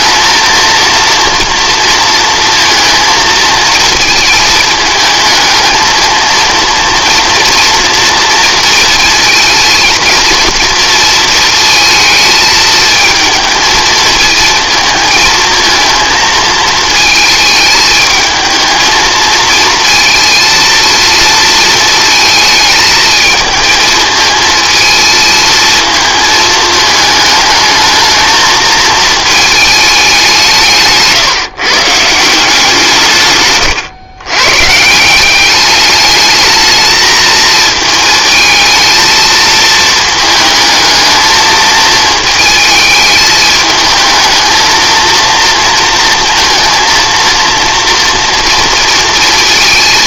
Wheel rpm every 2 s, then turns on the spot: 230, 230, 220, 230, 230, 230, 220, 230, 220, 220, 230, 220, 220, 220, 220, 160, 170, 140, 220, 220, 220, 220, 220, 230, 230.
none